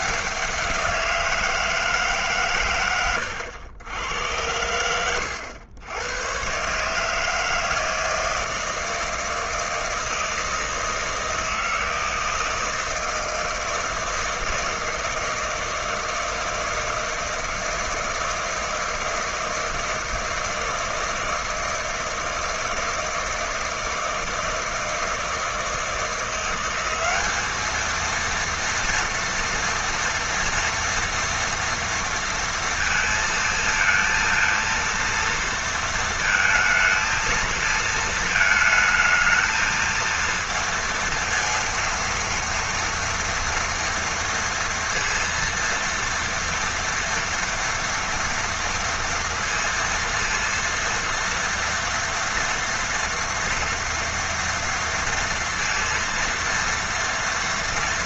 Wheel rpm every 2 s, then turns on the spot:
190, 120, 100, 130, 160, 160, 160, 160, 160, 160, 160, 160, 160, 180, 230, 240, 230, 230, 220, 220, 230, 230, 230, 230, 230, 230, 230, 230, 230.
none